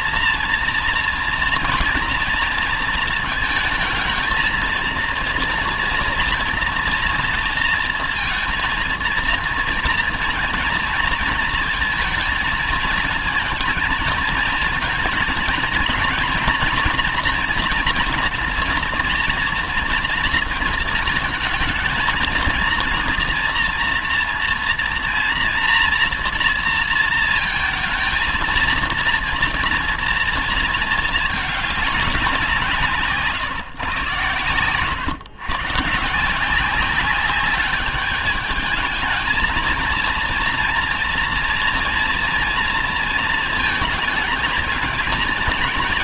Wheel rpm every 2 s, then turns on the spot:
230, 230, 230, 240, 230, 230, 220, 230, 230, 240, 230, 230, 230, 230, 230, 230, 170, 120, 180, 210, 230, 230, 220.
none